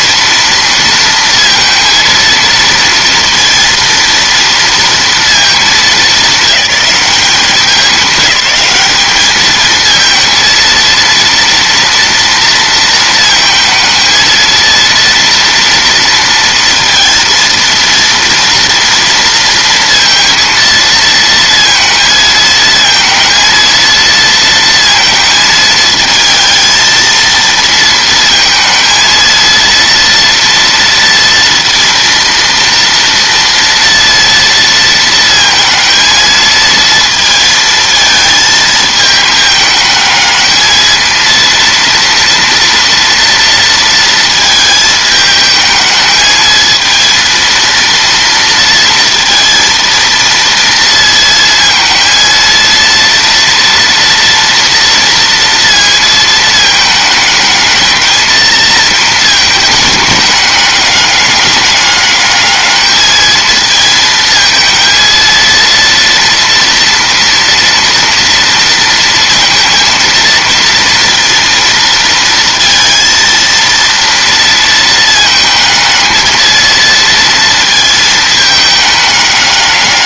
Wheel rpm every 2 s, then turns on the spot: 230, 230, 230, 210, 210, 230, 230, 230, 230, 230, 230, 220, 230, 220, 230, 230, 230, 230, 220, 220, 220, 230, 220, 220, 230, 230, 230, 230, 220, 220, 200, 210, 220, 230, 230, 230, 230, 230, 230, 210.
none